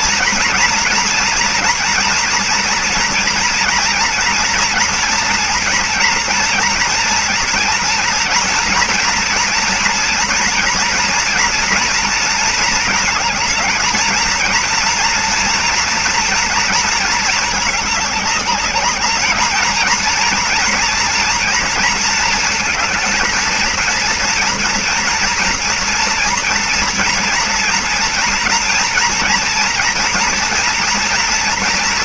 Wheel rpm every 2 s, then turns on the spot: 230, 240, 240, 230, 230, 230, 230, 230, 230, 200, 240, 220, 230, 230, 230, 240.
none